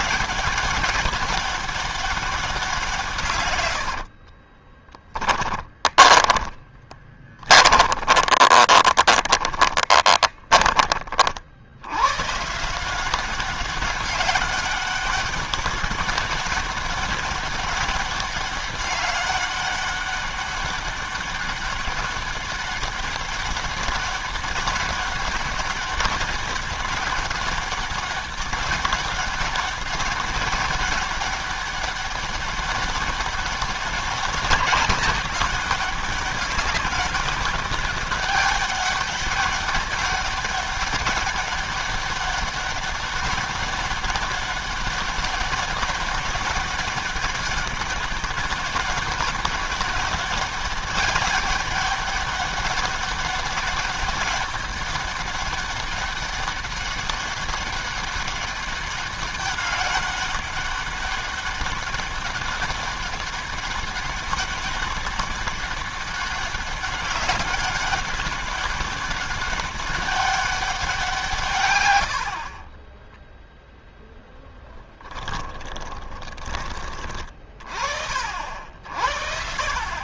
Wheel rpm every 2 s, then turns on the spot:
190, 180, 30, 20, 20, 20, 140, 200, 200, 200, 200, 200, 200, 200, 200, 200, 200, 190, 200, 200, 200, 200, 200, 200, 190, 200, 200, 200, 200, 200, 200, 200, 200, 200, 200, 190, 40, 0, 20, 50.
4-12 72-74